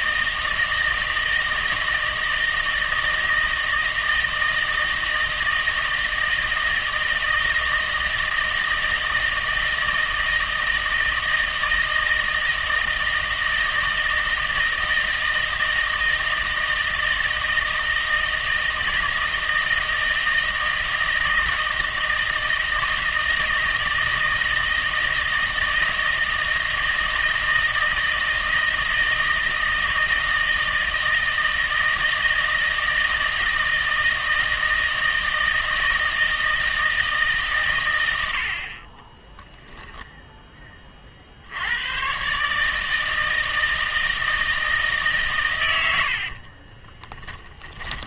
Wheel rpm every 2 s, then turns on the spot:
160, 160, 160, 160, 160, 160, 160, 160, 160, 160, 160, 160, 160, 160, 160, 160, 160, 160, 160, 50, 40, 150, 150, 30.
46-48